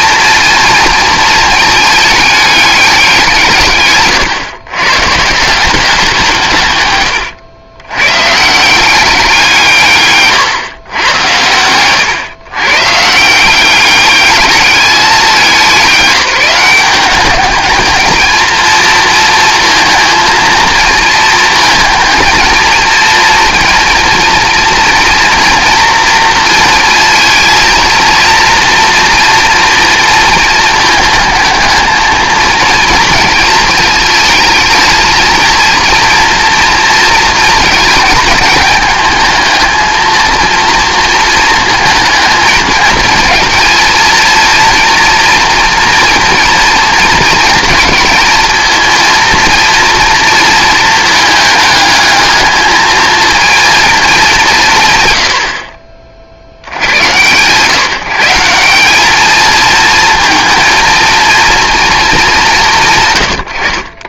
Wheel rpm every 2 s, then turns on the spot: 230, 210, 120, 140, 150, 130, 130, 210, 180, 230, 230, 230, 230, 230, 230, 220, 220, 220, 230, 220, 230, 220, 230, 230, 230, 230, 220, 180, 70, 190, 230, 170.
6-8